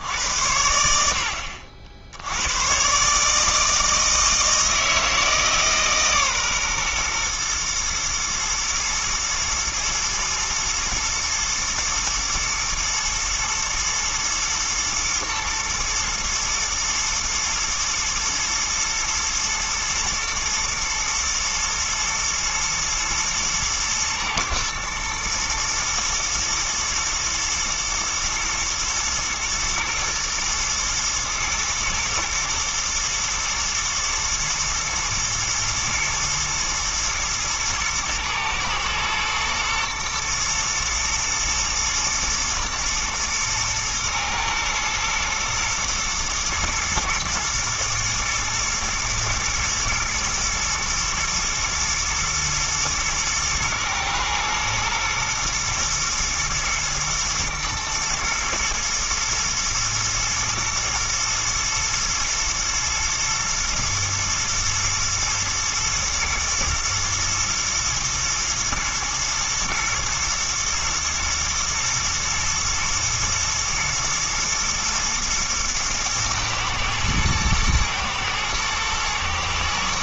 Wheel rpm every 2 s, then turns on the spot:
80, 130, 160, 120, 110, 110, 110, 120, 120, 120, 120, 110, 120, 110, 110, 110, 120, 120, 110, 110, 110, 110, 120, 110, 110, 120, 110, 110, 120, 110, 110, 120, 120, 110, 120, 110, 110, 120, 110, 110.
none